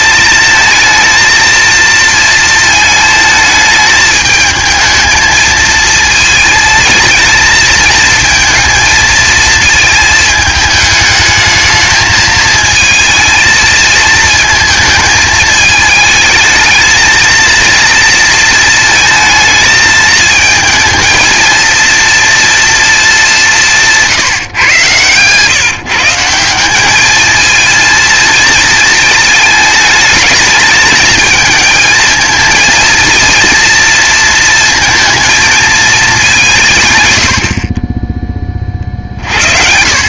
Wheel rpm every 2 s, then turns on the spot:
230, 220, 220, 230, 230, 210, 220, 220, 220, 220, 220, 220, 130, 200, 220, 220, 230, 220, 130, 40.
24-26